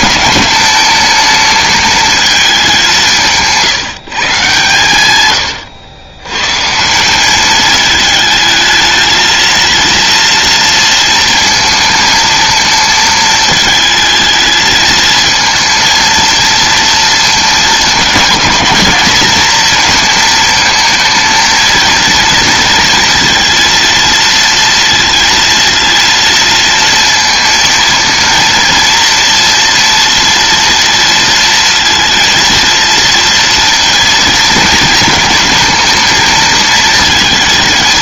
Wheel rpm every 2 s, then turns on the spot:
220, 200, 140, 140, 220, 230, 220, 220, 230, 210, 220, 230, 230, 230, 230, 230, 230, 230, 220.
none